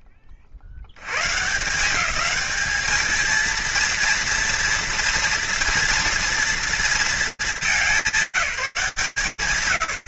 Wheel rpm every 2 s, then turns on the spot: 80, 220, 230, 230, 140.
none